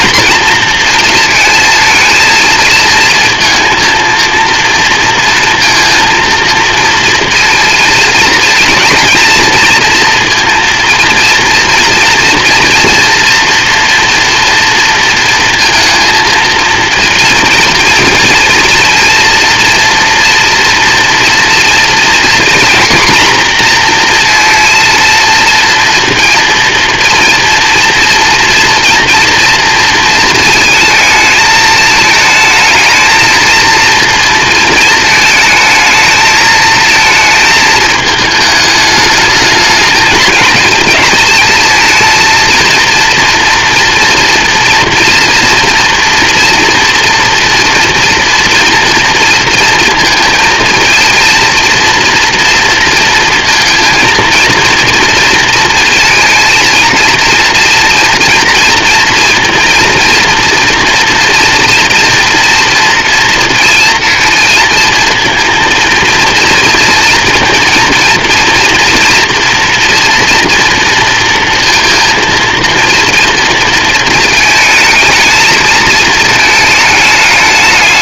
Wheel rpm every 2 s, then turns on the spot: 230, 230, 230, 230, 230, 230, 240, 230, 230, 230, 240, 240, 230, 230, 230, 220, 220, 220, 220, 220, 220, 230, 230, 240, 230, 230, 230, 230, 230, 230, 230, 230, 230, 230, 230, 230, 230, 220, 210.
none